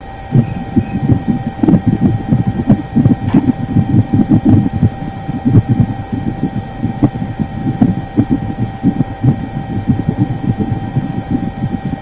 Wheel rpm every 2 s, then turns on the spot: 0, 0, 0, 0, 0, 0.
none